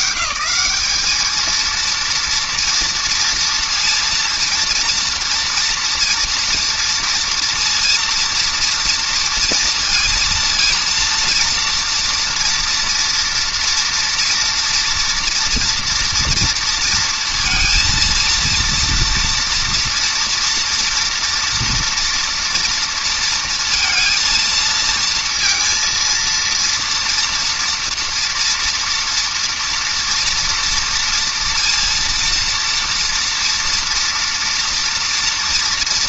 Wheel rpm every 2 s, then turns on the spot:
70, 230, 230, 230, 230, 230, 230, 230, 230, 230, 230, 230, 230, 230, 230, 240, 230, 230.
none